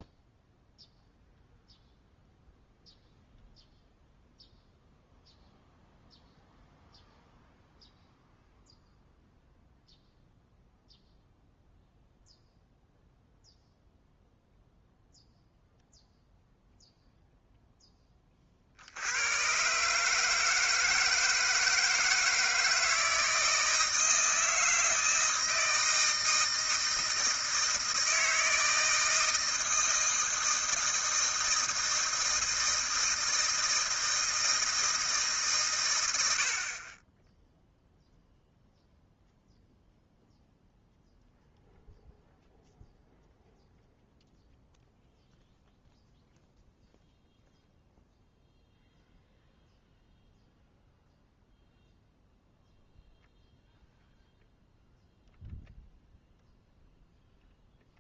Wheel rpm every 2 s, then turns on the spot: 0, 0, 0, 0, 0, 0, 0, 0, 0, 40, 160, 160, 160, 160, 160, 160, 160, 160, 60, 0, 0, 0, 0, 0, 0, 0, 0, 0, 0.
none